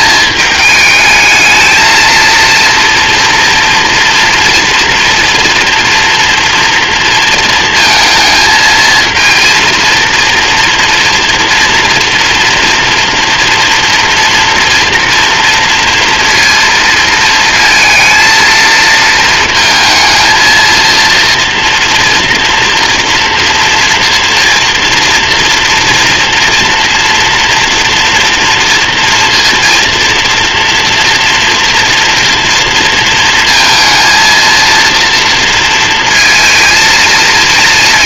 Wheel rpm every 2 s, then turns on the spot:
220, 230, 230, 230, 220, 230, 230, 230, 230, 230, 230, 230, 230, 240, 230, 230, 230, 230, 220.
none